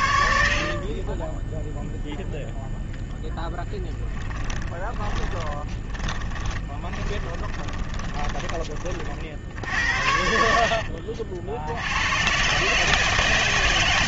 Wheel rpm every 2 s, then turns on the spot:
0, 30, 20, 30, 60, 120, 80.
2-6